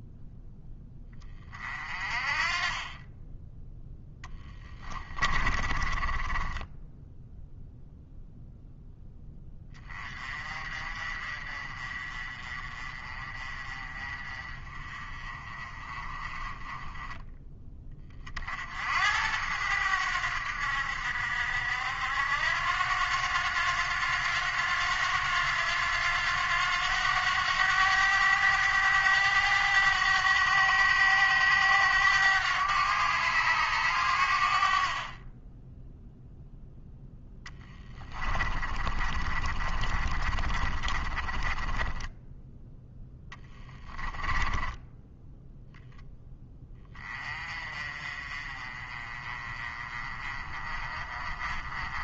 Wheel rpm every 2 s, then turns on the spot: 10, 30, 10, 10, 0, 30, 30, 30, 20, 70, 70, 90, 90, 90, 100, 100, 100, 40, 0, 30, 30, 0, 10, 20, 30, 30.
4-6 38-42 44-46